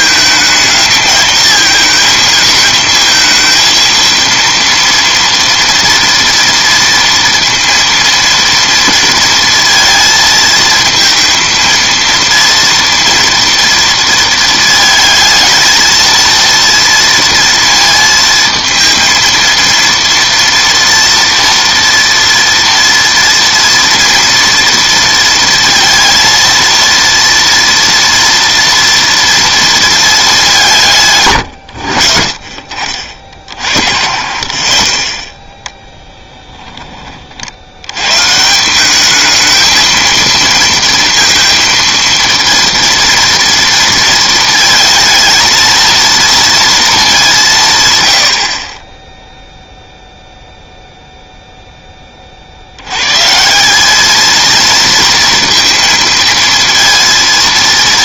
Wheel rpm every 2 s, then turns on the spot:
220, 220, 230, 240, 230, 230, 230, 220, 230, 230, 230, 230, 230, 230, 230, 180, 50, 40, 10, 180, 230, 230, 230, 230, 40, 0, 70, 230, 230.
none